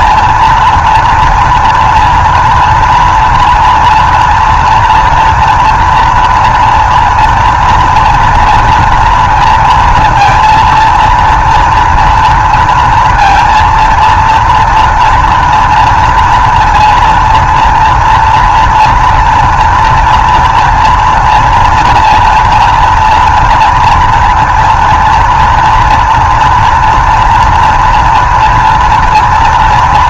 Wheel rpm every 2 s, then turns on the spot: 240, 230, 230, 230, 230, 230, 230, 230, 230, 230, 230, 230, 230, 240, 230.
none